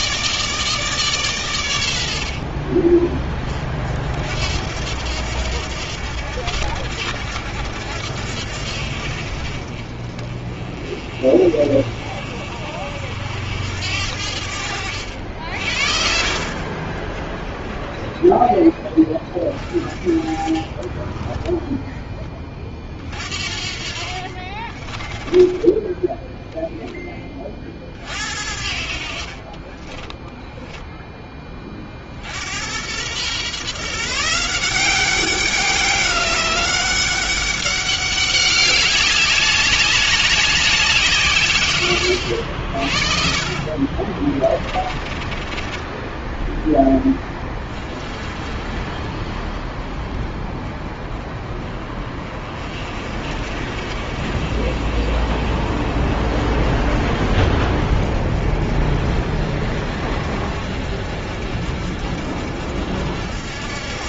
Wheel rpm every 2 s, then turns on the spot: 160, 50, 70, 70, 70, 30, 50, 70, 40, 10, 30, 20, 30, 0, 60, 10, 80, 170, 190, 190, 190, 60, 20, 10, 30, 20, 40, 50, 40, 40, 50, 60.
14-16 24-26 44-46